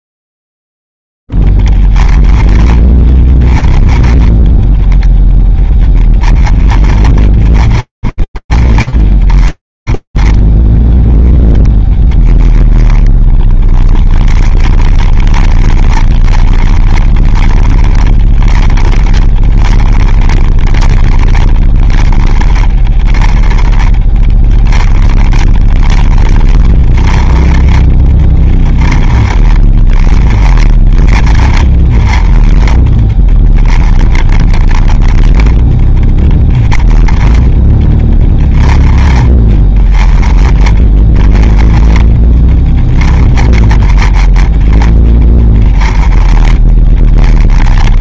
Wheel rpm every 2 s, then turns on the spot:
10, 20, 20, 20, 20, 10, 20, 30, 30, 20, 30, 20, 30, 20, 20, 30, 20, 20, 20, 20, 20, 30, 20, 20.
none